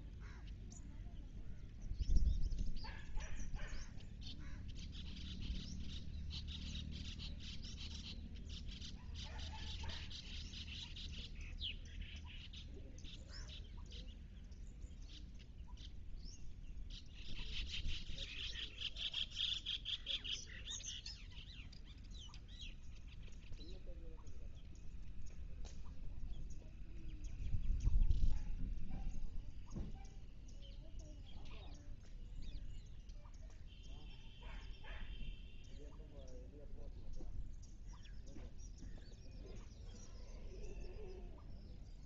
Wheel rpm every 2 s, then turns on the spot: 0, 0, 0, 0, 0, 0, 0, 0, 0, 0, 0, 0, 0, 0, 0, 0, 0, 0, 0, 0, 0.
none